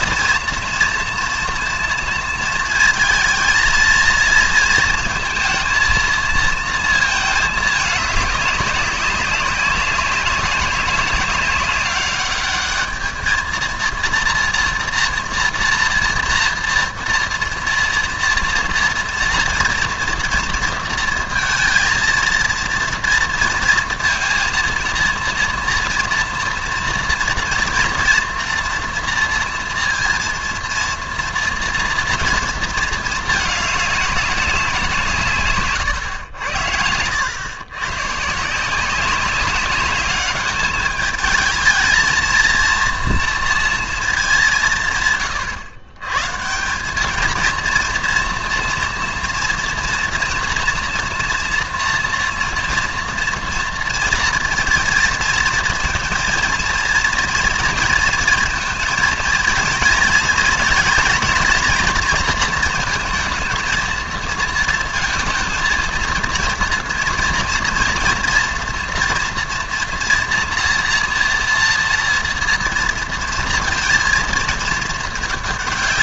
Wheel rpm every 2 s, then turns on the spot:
230, 230, 230, 230, 200, 200, 210, 230, 230, 240, 230, 230, 230, 230, 230, 230, 230, 190, 90, 170, 200, 230, 180, 160, 230, 230, 230, 230, 230, 230, 220, 230, 230, 230, 240, 230, 230, 220.
none